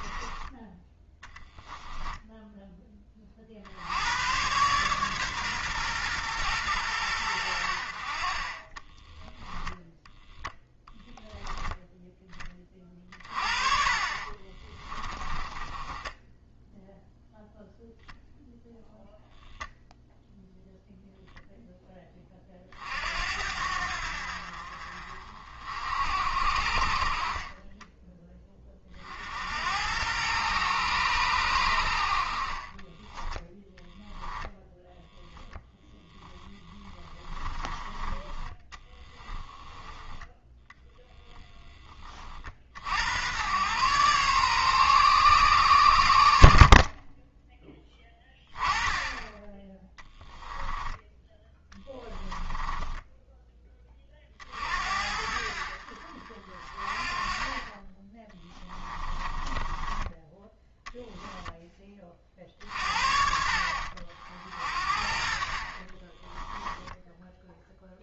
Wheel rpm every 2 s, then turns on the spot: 30, 10, 130, 100, 20, 0, 30, 20, 0, 0, 0, 50, 50, 40, 40, 110, 30, 0, 20, 20, 0, 70, 130, 40, 10, 10, 10, 60, 40, 10, 10, 50, 50, 10.
8-10 14-16 32-34 36-40 46-48 50-54 58-60